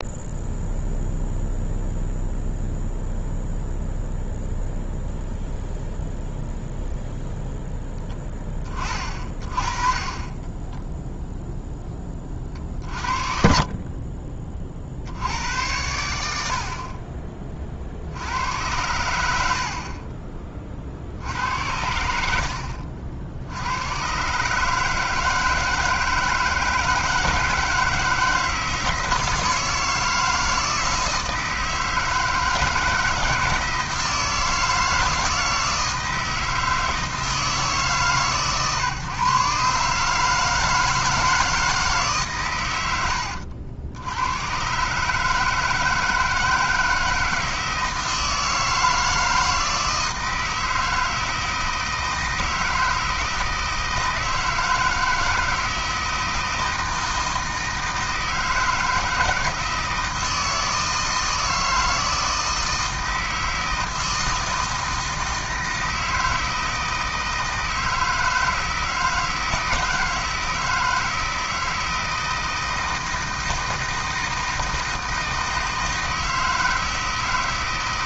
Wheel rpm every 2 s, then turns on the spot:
0, 0, 0, 0, 20, 20, 30, 30, 70, 90, 30, 70, 140, 160, 160, 160, 160, 160, 160, 130, 160, 130, 110, 160, 160, 160, 160, 160, 160, 160, 160, 160, 160, 160, 160, 160, 160, 160, 160.
10-12